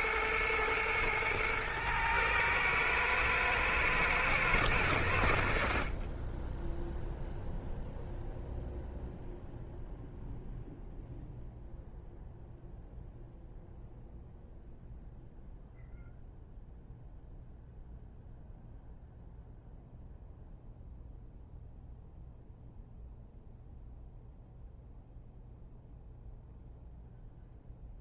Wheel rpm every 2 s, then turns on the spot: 110, 110, 100, 0, 0, 0, 0, 0, 0, 0, 0, 0, 0, 0.
none